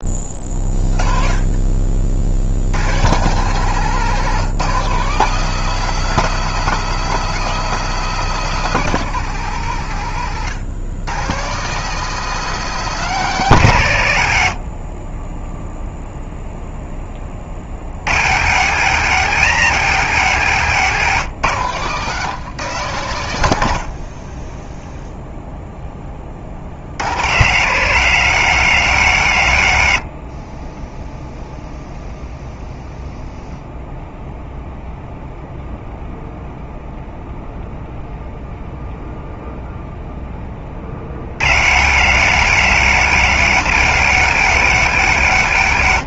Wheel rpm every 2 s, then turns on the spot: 30, 120, 170, 200, 180, 150, 180, 20, 10, 150, 150, 140, 0, 70, 130, 10, 0, 0, 0, 0, 40, 140, 140.
20-22